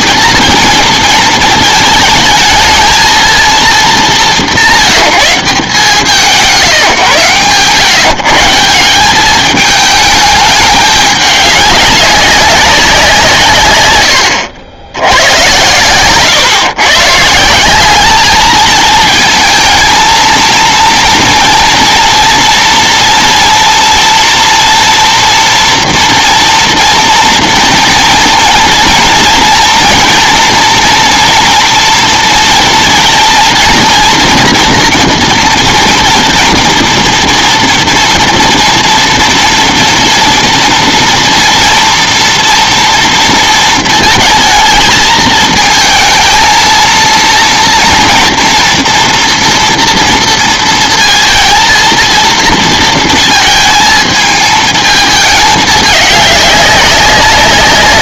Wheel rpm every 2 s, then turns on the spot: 220, 220, 160, 150, 160, 210, 200, 60, 120, 220, 230, 230, 230, 230, 230, 230, 230, 240, 230, 230, 230, 230, 230, 230, 230, 230, 230, 220, 200.
none